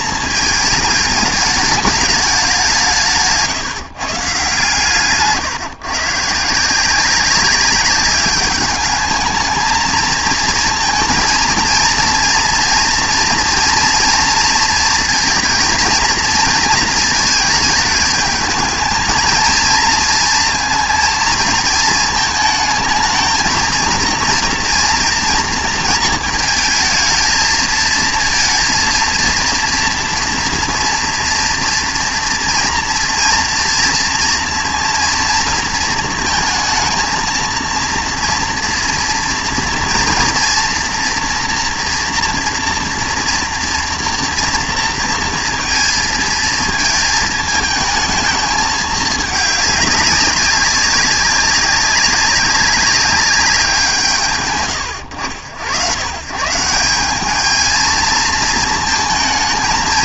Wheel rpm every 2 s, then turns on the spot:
220, 190, 150, 160, 210, 230, 230, 230, 220, 220, 230, 220, 230, 220, 230, 240, 240, 230, 220, 230, 230, 240, 230, 220, 220, 190, 200, 120, 160, 220.
none